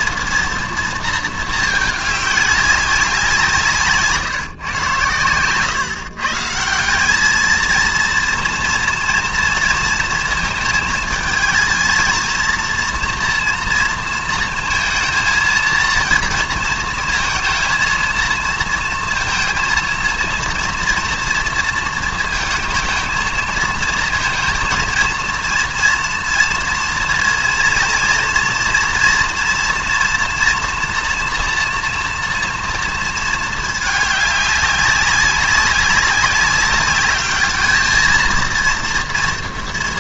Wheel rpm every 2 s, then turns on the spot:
230, 200, 140, 170, 230, 220, 230, 220, 230, 230, 240, 220, 230, 230, 230, 230, 230, 200, 200, 230.
none